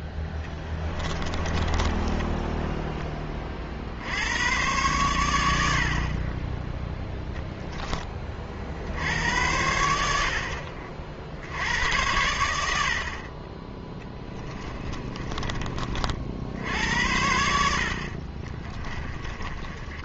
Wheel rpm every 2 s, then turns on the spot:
20, 10, 110, 10, 60, 60, 70, 20, 70, 30.
0-4 14-16 18-20